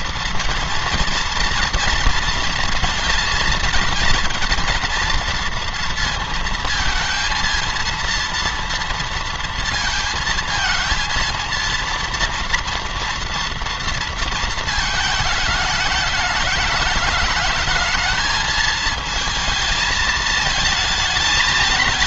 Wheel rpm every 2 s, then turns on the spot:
230, 230, 230, 230, 230, 230, 230, 220, 210, 220, 220.
none